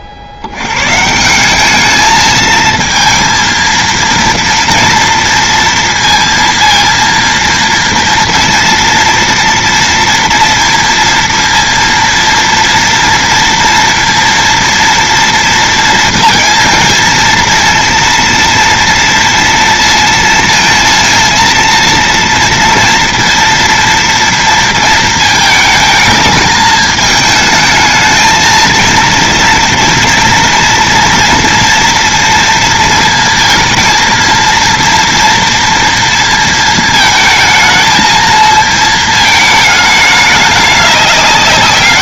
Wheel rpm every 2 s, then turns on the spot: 70, 230, 230, 230, 230, 230, 230, 230, 230, 230, 230, 230, 230, 220, 230, 230, 230, 230, 230, 230, 200.
none